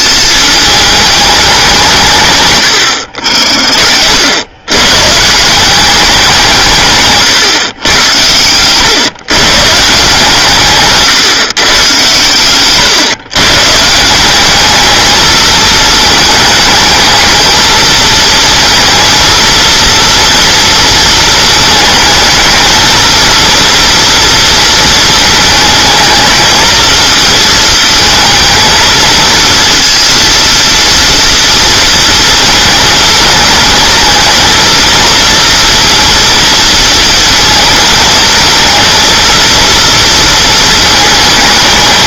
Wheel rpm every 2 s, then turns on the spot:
210, 110, 120, 150, 120, 150, 120, 210, 220, 230, 230, 220, 220, 220, 220, 230, 220, 230, 230, 230, 220.
2-4